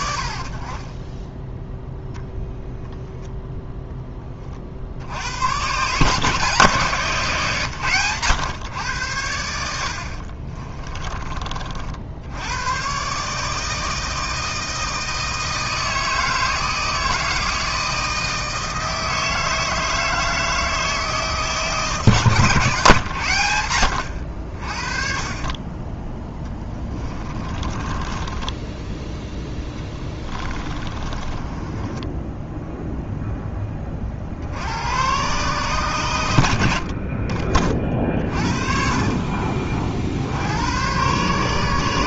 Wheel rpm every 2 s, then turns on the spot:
20, 0, 50, 150, 110, 30, 120, 160, 160, 160, 160, 130, 40, 20, 10, 20, 0, 100, 60, 40, 100.
0-2 10-12 26-32 38-40